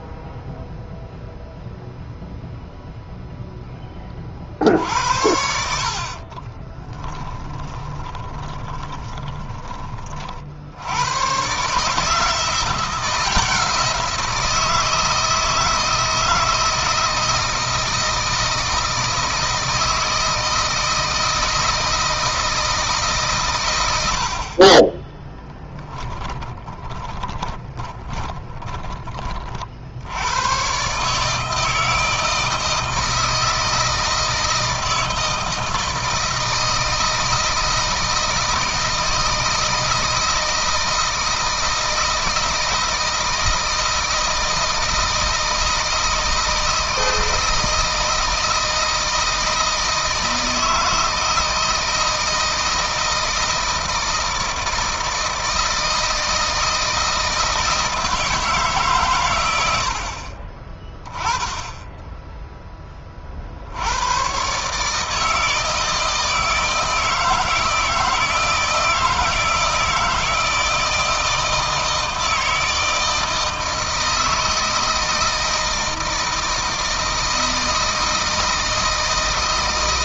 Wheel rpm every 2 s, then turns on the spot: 0, 0, 70, 30, 20, 80, 180, 160, 160, 160, 160, 150, 30, 20, 20, 130, 160, 160, 160, 160, 160, 160, 160, 160, 160, 160, 160, 160, 160, 140, 20, 20, 150, 160, 160, 160, 160, 160, 160, 160.
4-10 24-28